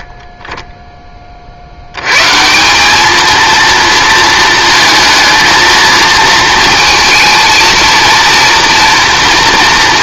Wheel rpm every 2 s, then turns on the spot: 20, 180, 230, 230, 240.
none